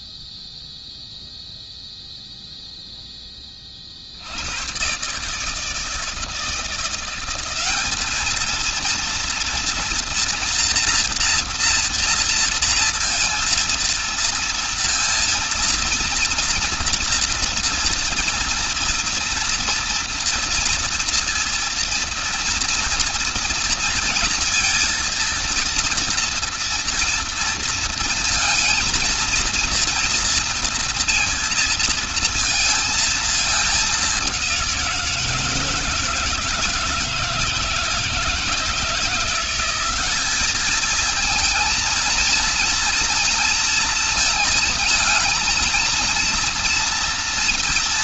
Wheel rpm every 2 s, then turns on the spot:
0, 10, 140, 180, 230, 230, 230, 230, 230, 230, 230, 230, 230, 230, 230, 230, 220, 170, 150, 170, 220, 230, 230, 230.
none